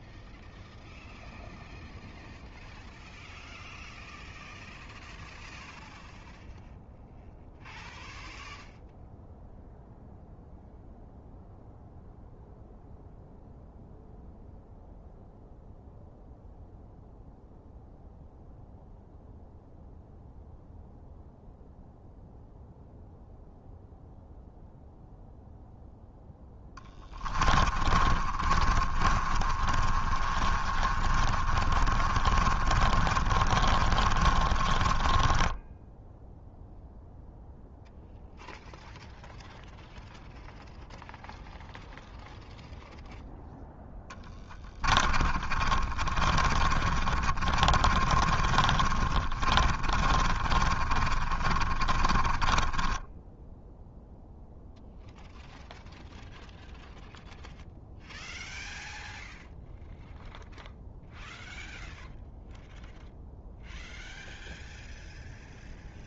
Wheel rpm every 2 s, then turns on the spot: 0, 0, 0, 0, 0, 0, 0, 0, 0, 0, 0, 0, 0, 0, 30, 30, 40, 30, 10, 0, 0, 0, 0, 30, 40, 40, 30, 0, 0, 0, 0, 0, 0.
28-38 46-54